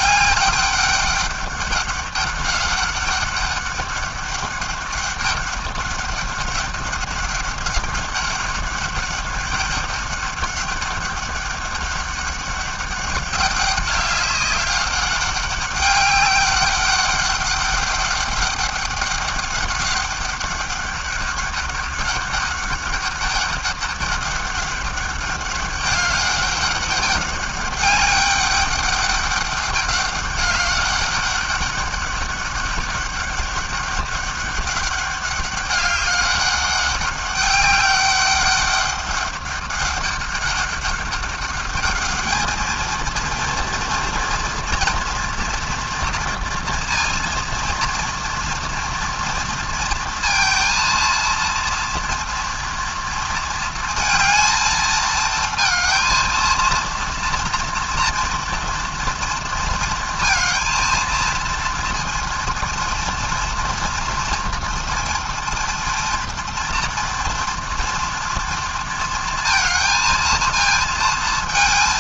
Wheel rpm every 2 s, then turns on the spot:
200, 200, 200, 200, 200, 200, 200, 200, 200, 200, 200, 200, 200, 200, 200, 200, 200, 200, 200, 200, 200, 220, 230, 230, 230, 230, 230, 220, 230, 230, 230, 230, 230, 230, 230, 230.
none